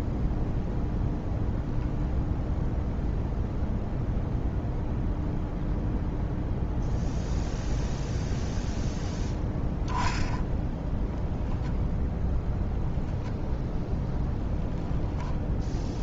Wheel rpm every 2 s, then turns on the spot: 0, 0, 0, 0, 0, 0, 0, 0.
none